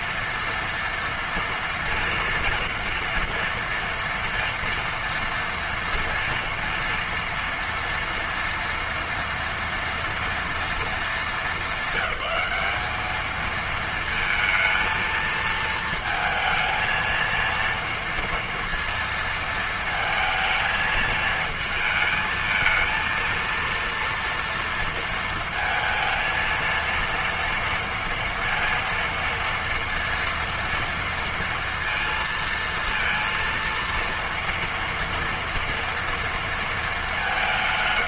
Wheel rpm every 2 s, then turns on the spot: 230, 240, 230, 230, 230, 230, 210, 230, 220, 230, 220, 230, 230, 230, 230, 230, 230, 230, 230.
none